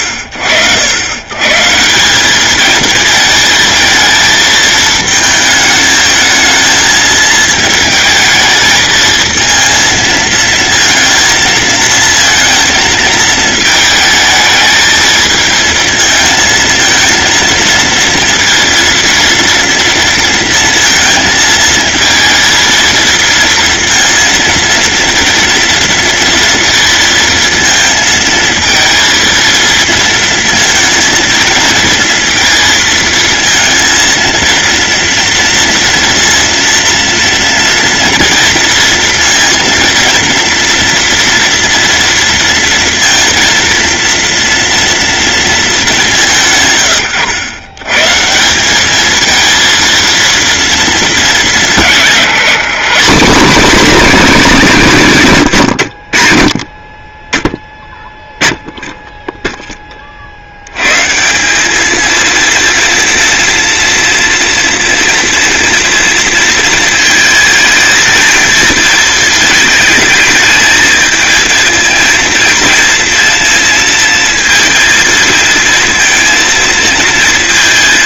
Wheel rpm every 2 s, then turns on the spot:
80, 220, 220, 230, 220, 220, 230, 220, 230, 230, 230, 230, 230, 230, 230, 230, 230, 230, 230, 230, 230, 230, 230, 130, 210, 230, 180, 190, 40, 10, 120, 230, 230, 220, 220, 220, 220, 230, 230.
none